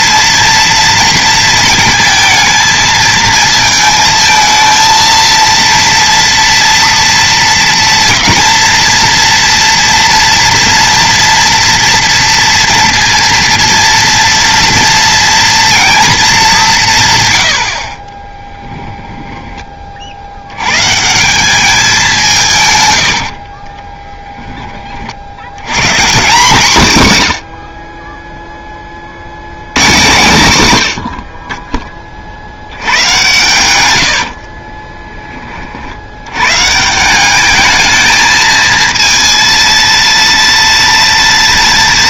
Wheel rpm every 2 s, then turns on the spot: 230, 220, 230, 230, 230, 230, 230, 230, 180, 10, 110, 140, 20, 160, 10, 130, 90, 40, 140, 230, 230.
18-20 34-36